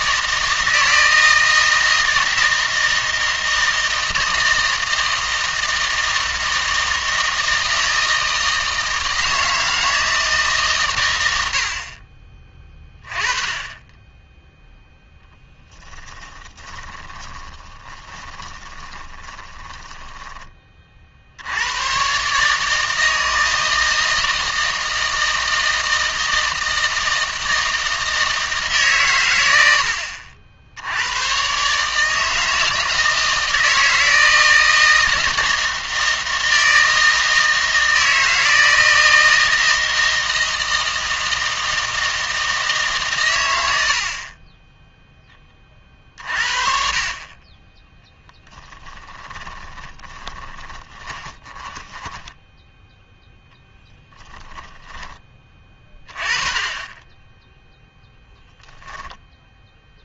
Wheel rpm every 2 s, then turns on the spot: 160, 160, 160, 160, 160, 140, 20, 0, 10, 20, 20, 150, 160, 160, 160, 60, 160, 160, 160, 160, 160, 160, 10, 40, 20, 20, 10, 20, 20, 0.
16-20 48-52 54-56